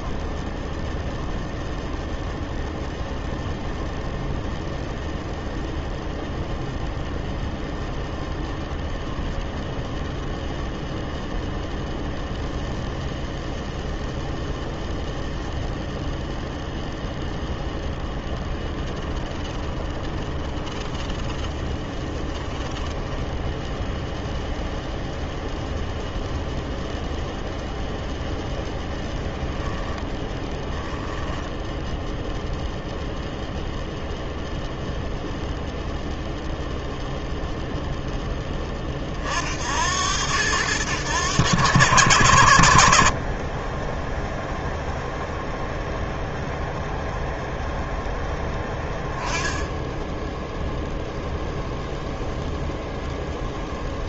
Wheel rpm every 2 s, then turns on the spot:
0, 0, 0, 0, 10, 0, 0, 0, 0, 20, 10, 10, 0, 0, 0, 10, 0, 0, 0, 30, 100, 80, 0, 0, 10, 0, 0.
18-24